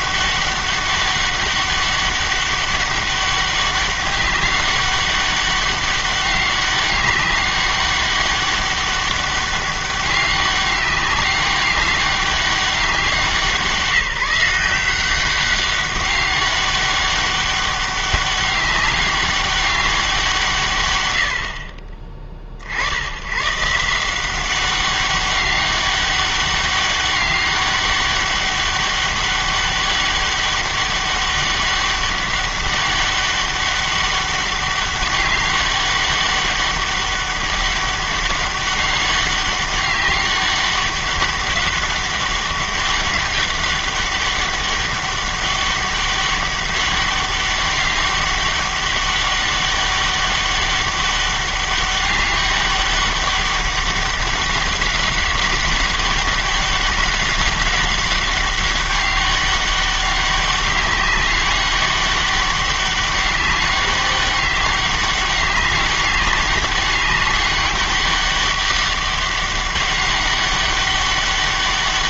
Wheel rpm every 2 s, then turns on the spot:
200, 200, 200, 200, 200, 190, 200, 180, 200, 200, 140, 50, 190, 200, 200, 200, 200, 200, 200, 200, 200, 200, 200, 200, 200, 200, 200, 200, 200, 200, 200, 200, 200, 200, 200, 200.
none